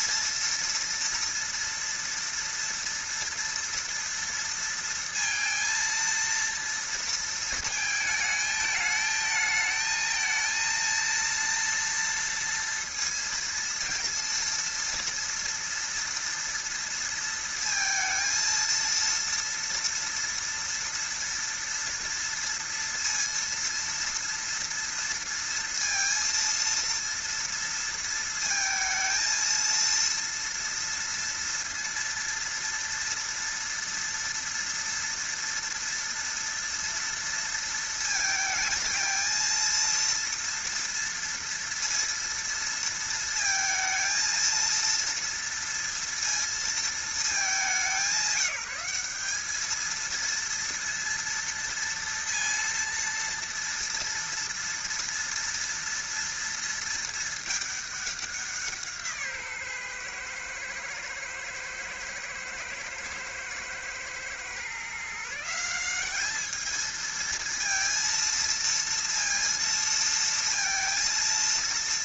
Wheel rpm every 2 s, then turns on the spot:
230, 230, 230, 230, 220, 230, 230, 230, 230, 230, 230, 230, 230, 230, 230, 230, 230, 230, 230, 220, 230, 230, 230, 210, 200, 230, 230, 230, 220, 160, 110, 110, 140, 220, 230, 230.
none